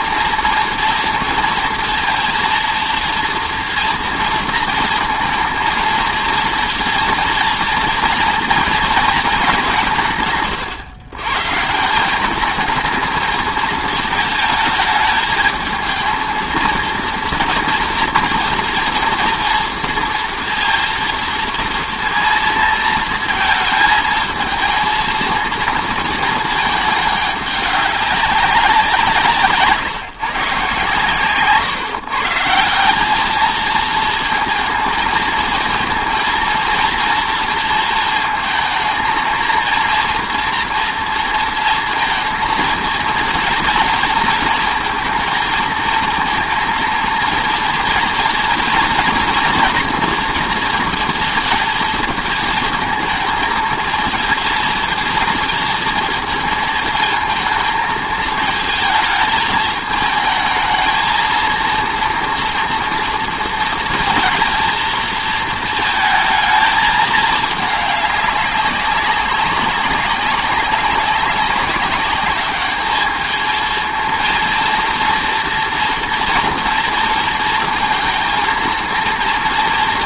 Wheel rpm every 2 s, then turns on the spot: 230, 230, 230, 230, 230, 130, 220, 220, 230, 230, 230, 230, 220, 210, 180, 140, 180, 230, 230, 230, 230, 230, 230, 230, 240, 230, 230, 230, 220, 220, 220, 230, 230, 220, 200, 200, 210, 230, 230, 230.
none